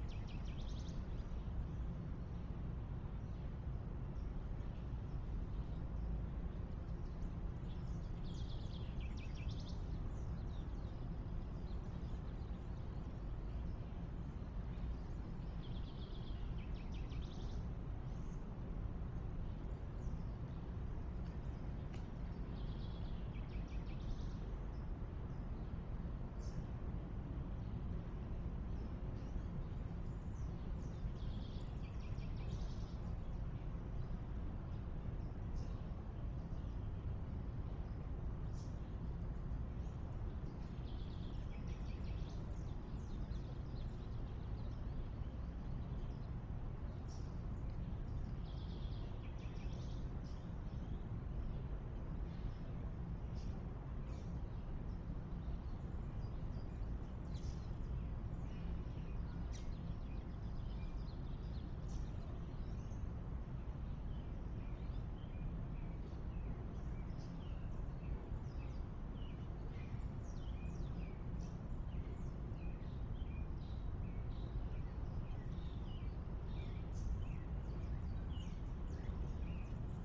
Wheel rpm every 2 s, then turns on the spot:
0, 0, 0, 0, 0, 0, 0, 0, 0, 0, 0, 0, 0, 0, 0, 0, 0, 0, 0, 0, 0, 0, 0, 0, 0, 0, 0, 0, 0, 0, 0, 0, 0, 0, 0, 0, 0, 0, 0, 0.
none